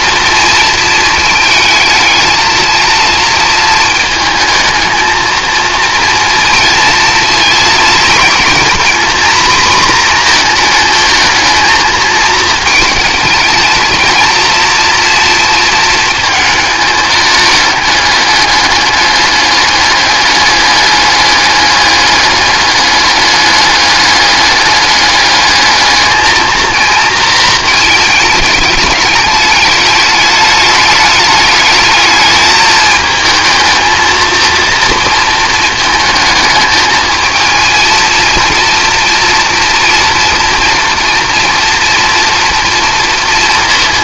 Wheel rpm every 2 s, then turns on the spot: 230, 220, 220, 230, 240, 230, 220, 230, 220, 210, 210, 210, 210, 220, 210, 210, 210, 230, 220, 230, 230, 230.
none